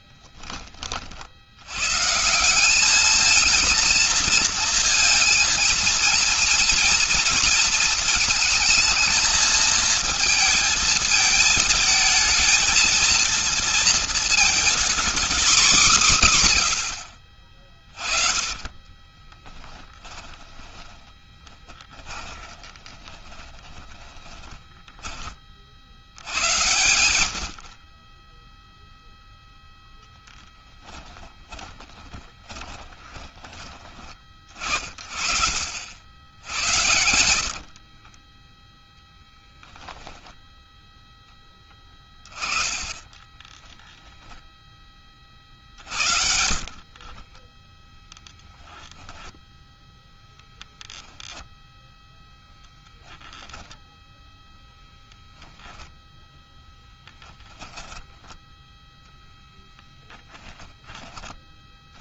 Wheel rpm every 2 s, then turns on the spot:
10, 180, 230, 240, 230, 220, 220, 230, 160, 30, 20, 20, 20, 90, 10, 20, 30, 50, 100, 20, 0, 30, 10, 60, 0, 0, 10, 10, 0, 10, 30.
18-26 32-34 36-40 42-44 46-48 52-54